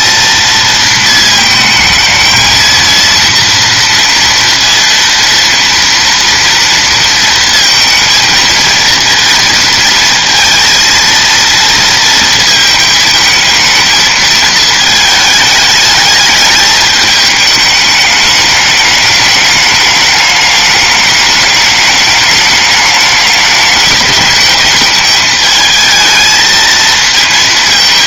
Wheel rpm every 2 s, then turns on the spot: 230, 230, 230, 230, 230, 230, 220, 220, 210, 210, 210, 210, 210, 220.
none